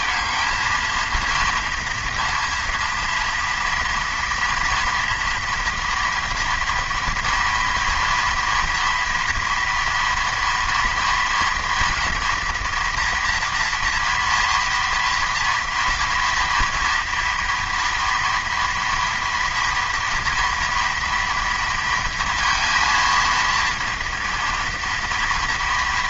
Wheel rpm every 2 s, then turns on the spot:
230, 230, 230, 240, 230, 230, 230, 230, 230, 230, 230, 230, 230.
none